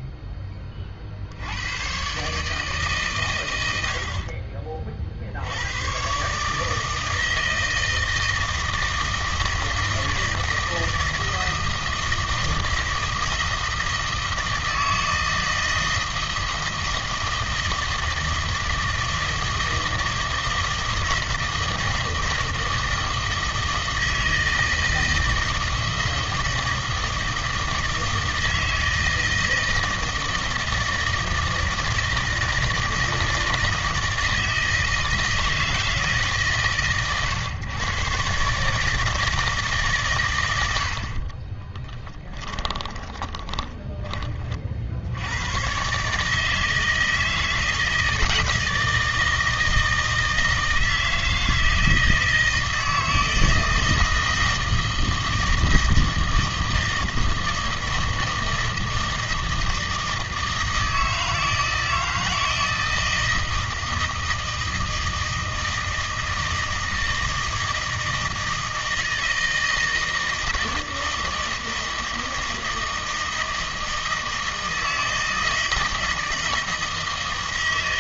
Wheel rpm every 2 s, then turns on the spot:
30, 140, 40, 160, 160, 160, 160, 160, 160, 160, 160, 160, 160, 160, 160, 160, 160, 160, 130, 150, 70, 20, 50, 160, 160, 160, 160, 160, 160, 160, 160, 160, 160, 160, 160, 160, 160, 160, 160.
42-44